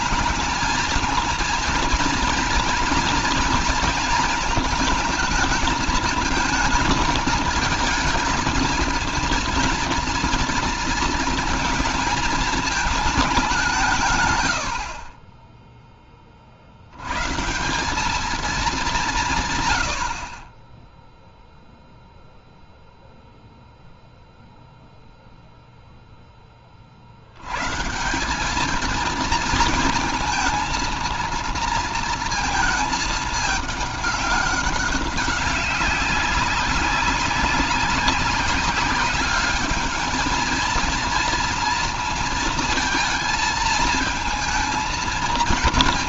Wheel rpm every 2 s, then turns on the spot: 220, 240, 220, 220, 230, 230, 220, 70, 70, 210, 20, 0, 0, 30, 210, 220, 220, 200, 190, 190, 220, 230, 230.
none